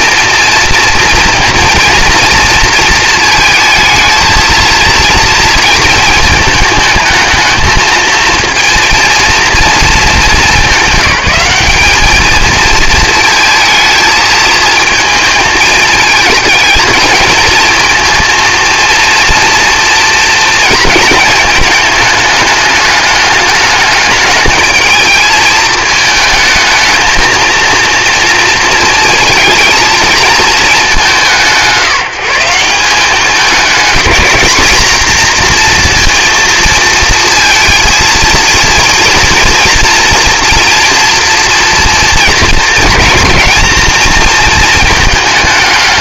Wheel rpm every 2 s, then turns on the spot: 230, 230, 230, 220, 230, 210, 220, 220, 220, 230, 230, 210, 220, 220, 230, 210, 180, 230, 230, 230, 230, 230, 220.
none